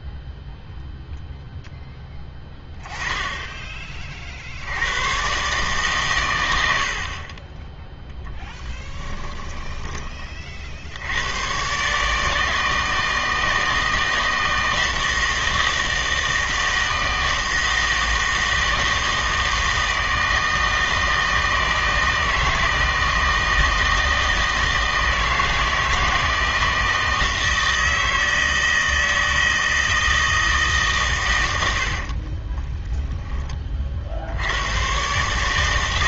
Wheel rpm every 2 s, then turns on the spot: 0, 10, 90, 80, 10, 60, 160, 160, 160, 160, 160, 160, 160, 160, 160, 150, 10, 120.
8-10 32-34